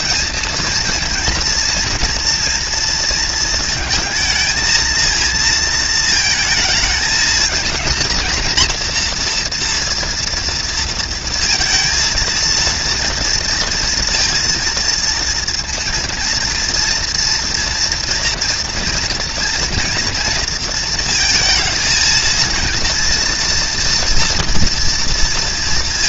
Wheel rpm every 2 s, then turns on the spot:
230, 230, 230, 220, 230, 230, 230, 230, 230, 230, 230, 230, 230.
none